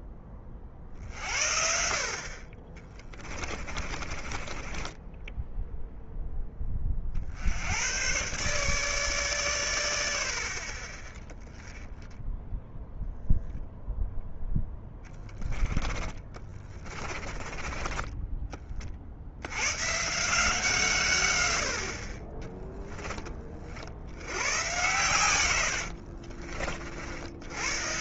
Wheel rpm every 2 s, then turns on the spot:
40, 40, 20, 30, 140, 40, 0, 10, 20, 50, 140, 10, 110, 60.
2-6 16-18